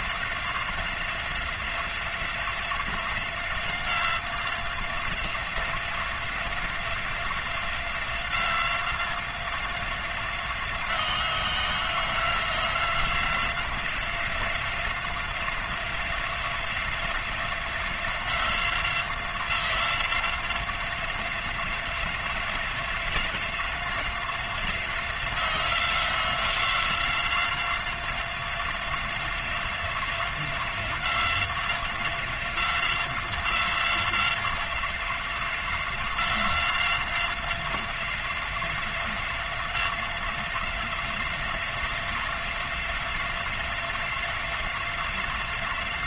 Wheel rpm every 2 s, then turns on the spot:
180, 180, 180, 180, 180, 180, 180, 180, 180, 180, 180, 180, 180, 180, 180, 180, 180, 180, 180, 180, 180, 180, 180.
none